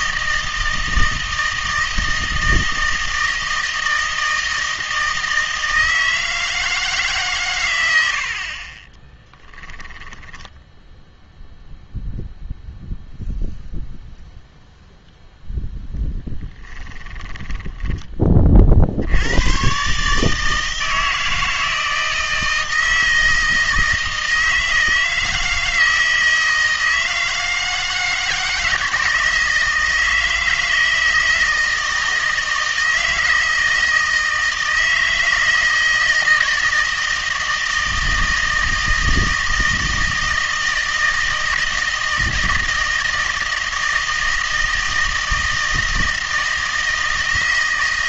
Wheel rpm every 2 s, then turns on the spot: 160, 160, 160, 150, 20, 0, 0, 0, 30, 60, 160, 160, 160, 160, 160, 160, 160, 160, 160, 160, 160, 160, 160, 160.
8-10 16-18